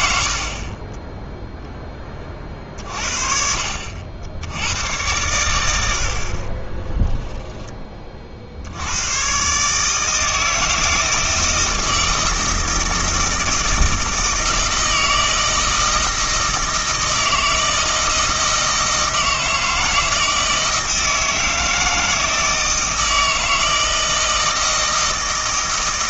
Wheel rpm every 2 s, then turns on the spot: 20, 50, 100, 20, 80, 160, 160, 160, 160, 160, 160, 160, 160.
0-2 6-8